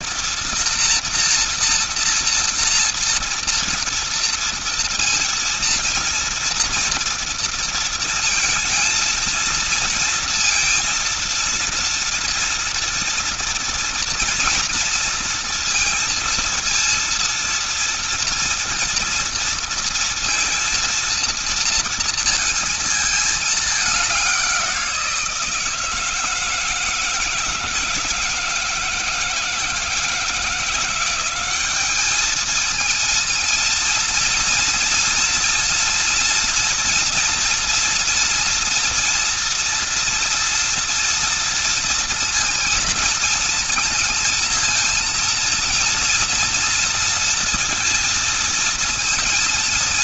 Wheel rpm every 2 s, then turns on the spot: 230, 230, 230, 230, 230, 230, 230, 230, 230, 230, 230, 230, 180, 160, 160, 180, 230, 230, 240, 240, 230, 230, 230, 230, 230.
none